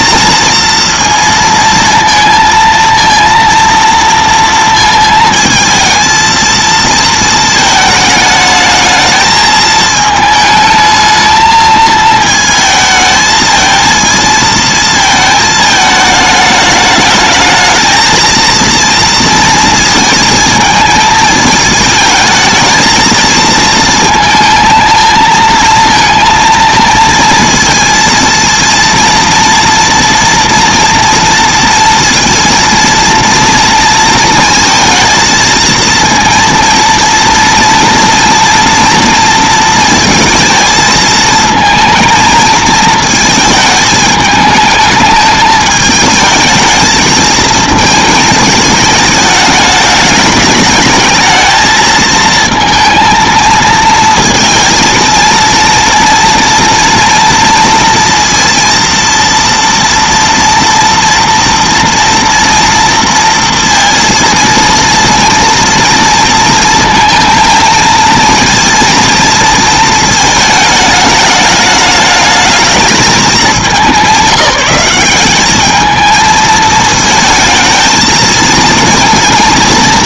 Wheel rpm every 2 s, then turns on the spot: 230, 230, 230, 230, 220, 220, 220, 230, 210, 230, 220, 220, 220, 230, 230, 240, 230, 220, 230, 230, 220, 220, 210, 220, 220, 210, 230, 230, 230, 230, 230, 230, 230, 230, 230, 220, 210, 190, 220, 230.
none